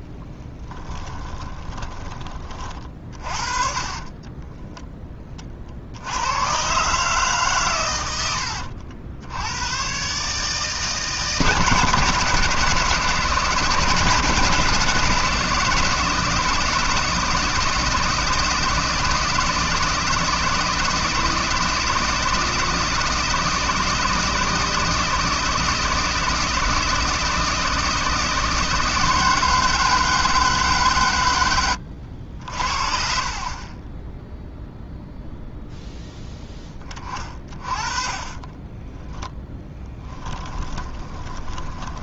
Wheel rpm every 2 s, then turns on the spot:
10, 50, 20, 130, 70, 150, 150, 150, 160, 160, 160, 160, 160, 160, 170, 150, 50, 0, 20, 10, 20.
0-4 38-42